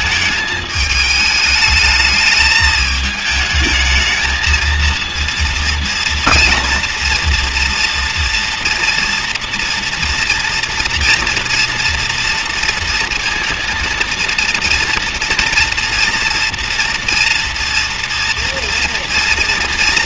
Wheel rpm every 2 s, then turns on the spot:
210, 210, 230, 230, 230, 230, 230, 230, 230, 230.
none